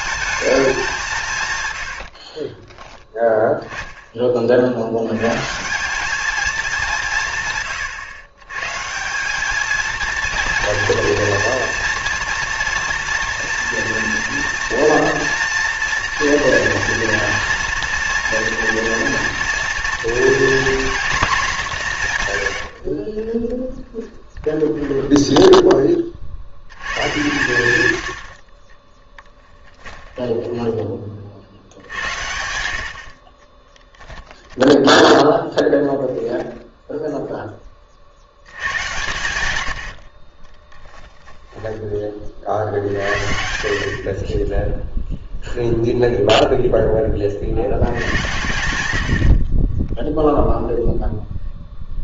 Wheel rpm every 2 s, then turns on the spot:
190, 10, 70, 190, 150, 240, 240, 230, 230, 230, 240, 70, 10, 100, 20, 10, 80, 10, 10, 100, 20, 60, 10, 0, 100, 0.
22-26 28-30 34-36 40-42